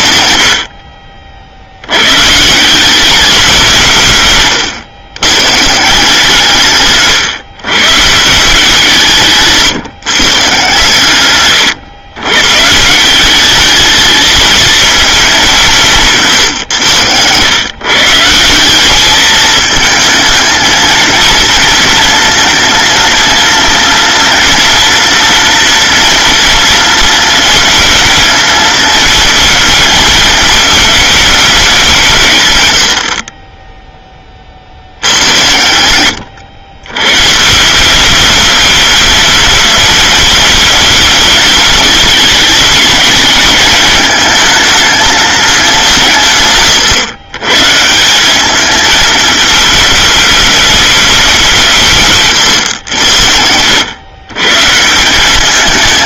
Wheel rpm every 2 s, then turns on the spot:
50, 200, 110, 140, 150, 120, 190, 220, 110, 210, 230, 230, 230, 220, 220, 210, 40, 80, 120, 210, 210, 220, 210, 120, 220, 190, 80, 190.
none